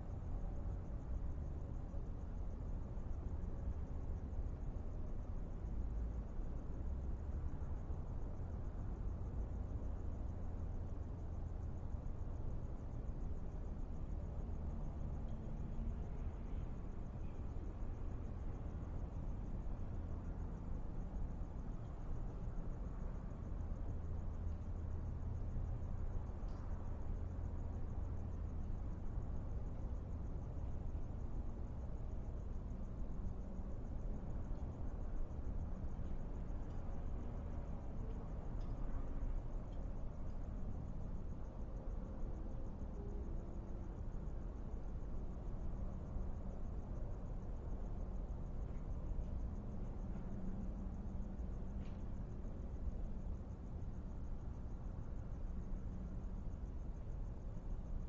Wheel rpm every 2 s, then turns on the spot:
0, 0, 0, 0, 0, 0, 0, 0, 0, 0, 0, 0, 0, 0, 0, 0, 0, 0, 0, 0, 0, 0, 0, 0, 0, 0, 0, 0, 0.
none